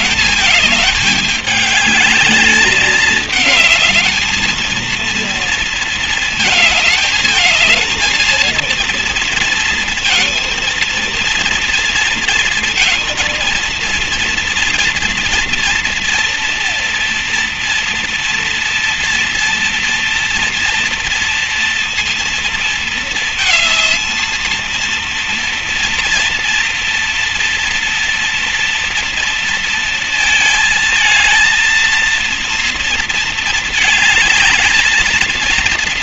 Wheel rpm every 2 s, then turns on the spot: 210, 210, 230, 210, 230, 230, 230, 230, 230, 230, 230, 230, 220, 230, 230, 220, 230, 220.
none